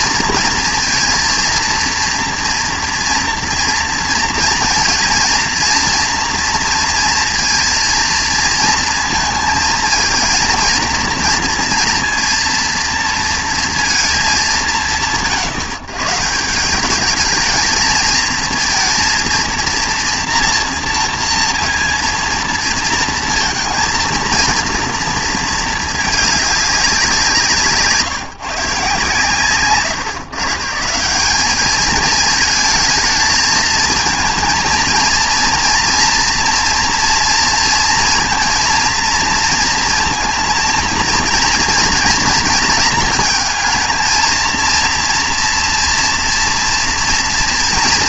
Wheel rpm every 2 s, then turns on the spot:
230, 230, 230, 230, 230, 230, 230, 130, 170, 230, 240, 230, 230, 200, 160, 150, 220, 230, 230, 230, 230, 230, 230, 230.
none